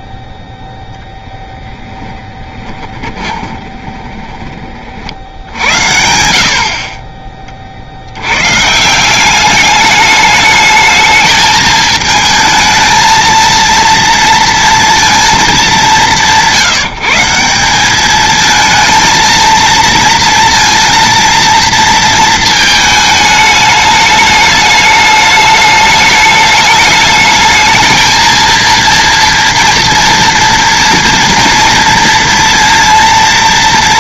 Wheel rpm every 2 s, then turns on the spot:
0, 20, 60, 40, 190, 220, 230, 230, 170, 220, 230, 210, 210, 210, 230, 230, 230.
2-4